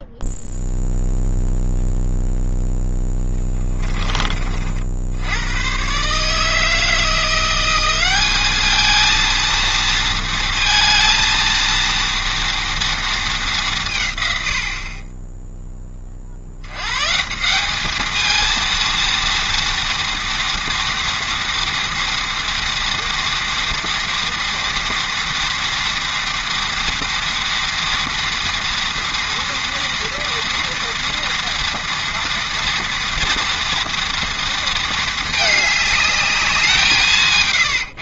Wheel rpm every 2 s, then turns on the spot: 0, 10, 70, 160, 220, 230, 230, 30, 120, 230, 230, 230, 230, 230, 230, 230, 240, 220, 170.
none